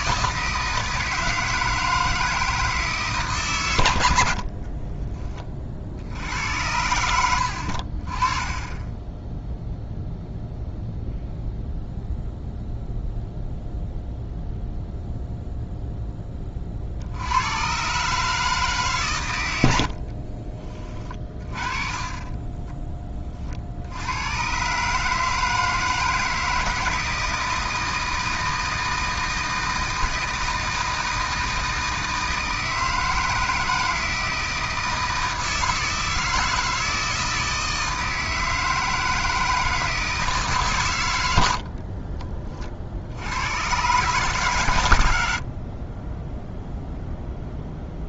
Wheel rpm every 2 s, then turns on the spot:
160, 160, 70, 90, 20, 0, 0, 0, 30, 150, 30, 10, 130, 160, 160, 160, 160, 160, 160, 160, 130, 30, 120, 0.
22-24